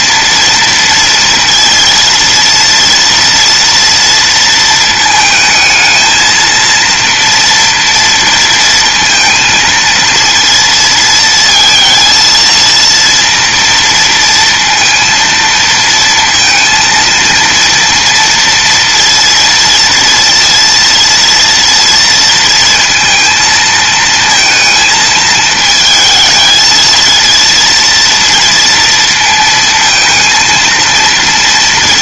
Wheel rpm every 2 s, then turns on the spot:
230, 240, 220, 230, 230, 230, 230, 230, 230, 230, 230, 230, 220, 230, 230, 230.
none